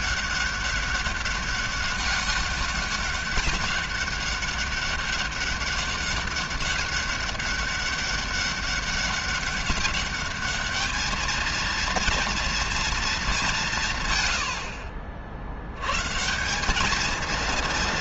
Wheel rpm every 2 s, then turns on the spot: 190, 200, 200, 200, 200, 210, 230, 80, 190.
none